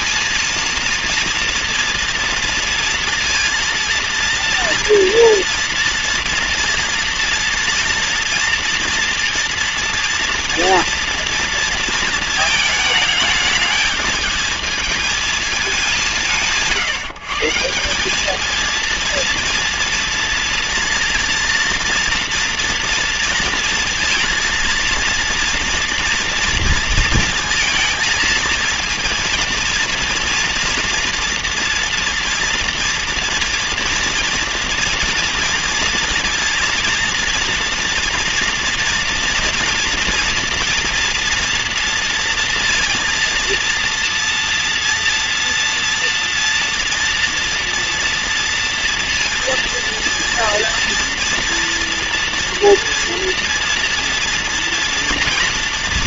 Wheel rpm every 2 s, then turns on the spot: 230, 230, 230, 230, 230, 230, 220, 220, 160, 230, 240, 240, 230, 230, 230, 230, 230, 230, 230, 240, 230, 230, 230, 230, 240, 230, 230, 230.
none